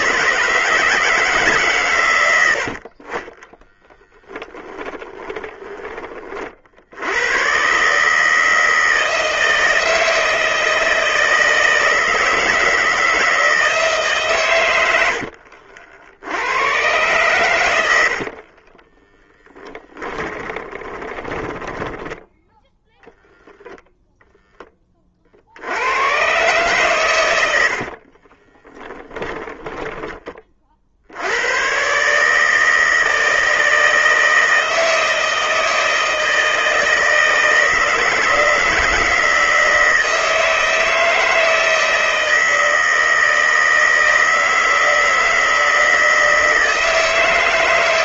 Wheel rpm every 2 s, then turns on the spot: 160, 70, 20, 70, 160, 160, 160, 110, 110, 40, 20, 0, 20, 130, 20, 40, 160, 160, 160, 160, 160, 160, 160, 160.
2-6 18-22 28-30